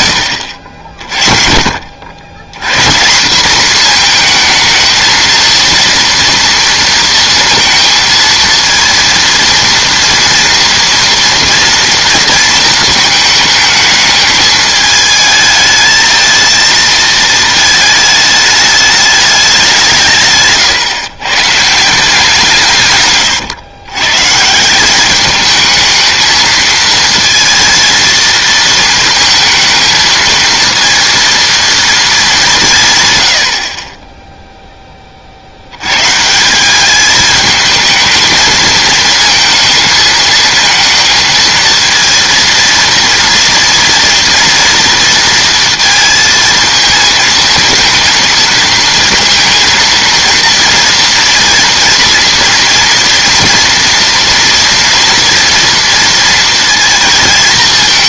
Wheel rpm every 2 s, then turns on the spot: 70, 120, 230, 230, 230, 230, 230, 220, 220, 210, 140, 150, 180, 230, 230, 230, 170, 10, 180, 220, 230, 230, 240, 220, 230, 230, 230, 230, 230.
20-22